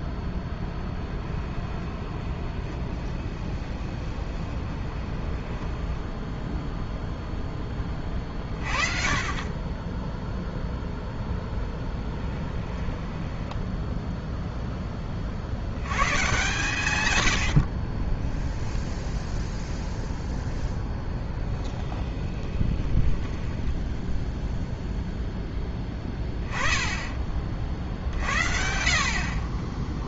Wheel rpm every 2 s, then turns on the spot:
20, 20, 20, 0, 30, 0, 10, 10, 130, 10, 0, 20, 0, 10, 60.
0-6 12-14 22-24